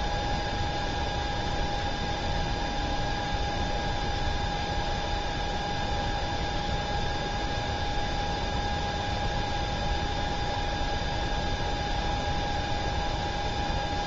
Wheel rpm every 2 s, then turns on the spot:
0, 0, 0, 0, 0, 0, 0.
none